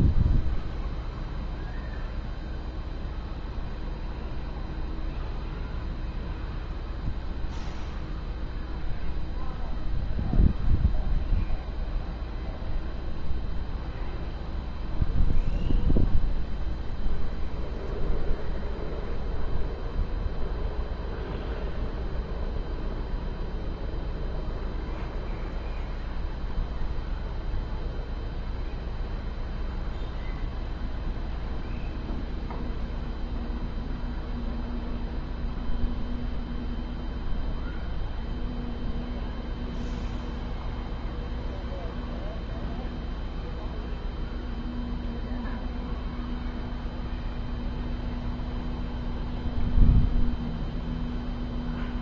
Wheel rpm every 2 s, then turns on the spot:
0, 0, 0, 0, 0, 0, 0, 0, 0, 0, 0, 0, 0, 0, 0, 0, 0, 0, 0, 0, 0, 0, 0, 0, 0, 0.
none